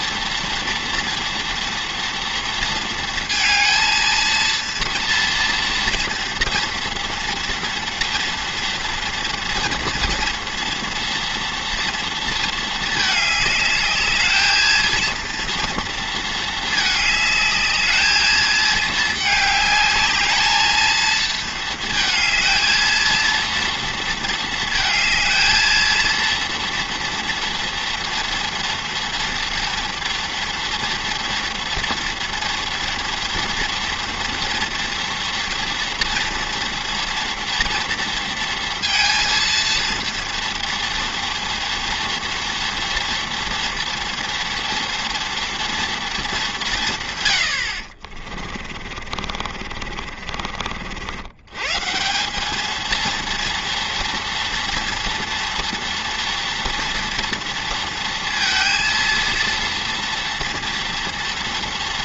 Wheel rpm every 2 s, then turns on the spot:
230, 230, 230, 230, 230, 230, 220, 230, 220, 220, 220, 220, 220, 230, 230, 230, 230, 230, 230, 230, 230, 230, 230, 160, 50, 60, 220, 230, 240, 230, 230.
48-50